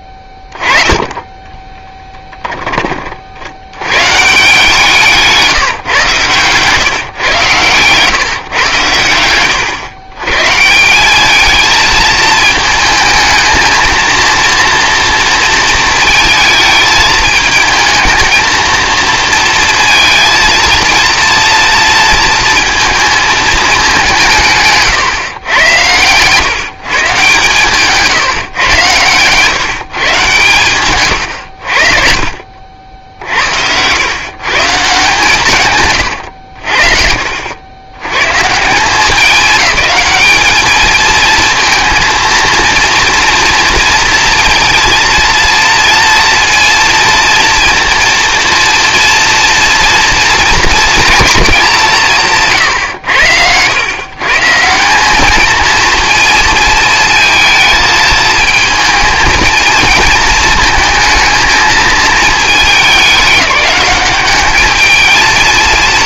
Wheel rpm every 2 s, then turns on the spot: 20, 10, 140, 130, 120, 130, 220, 230, 220, 220, 230, 230, 180, 120, 140, 140, 50, 120, 100, 120, 210, 230, 230, 230, 230, 230, 160, 140, 230, 220, 230, 220, 200.
36-38